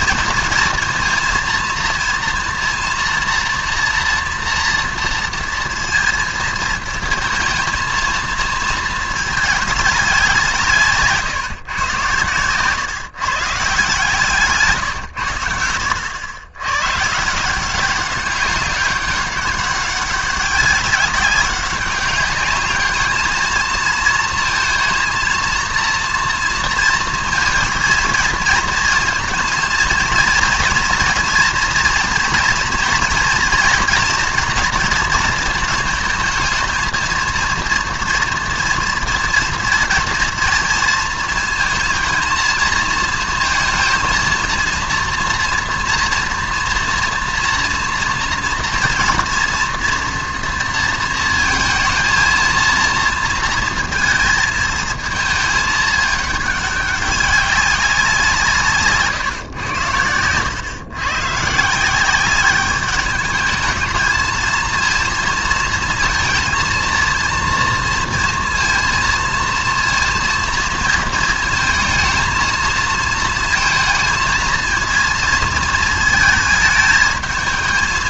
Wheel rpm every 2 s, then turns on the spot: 230, 230, 230, 220, 220, 170, 130, 130, 120, 200, 200, 210, 230, 230, 230, 230, 230, 230, 220, 230, 230, 220, 230, 230, 230, 230, 230, 220, 200, 150, 120, 200, 230, 230, 230, 230, 230, 230, 220.
10-12 14-16